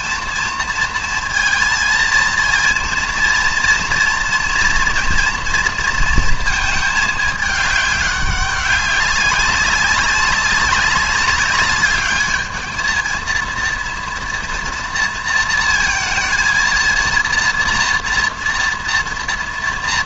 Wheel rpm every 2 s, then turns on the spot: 230, 230, 230, 220, 190, 200, 220, 230, 230, 240.
none